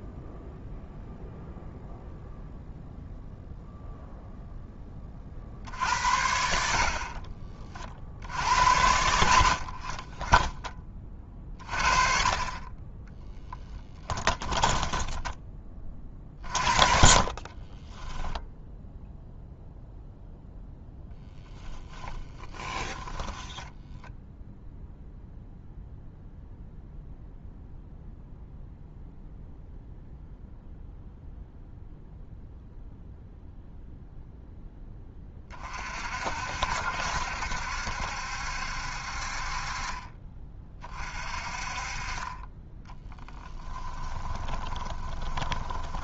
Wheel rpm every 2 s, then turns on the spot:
0, 0, 10, 50, 70, 20, 20, 10, 40, 0, 10, 20, 0, 0, 0, 0, 0, 10, 70, 60, 30, 20, 20.
14-18 22-24 44-46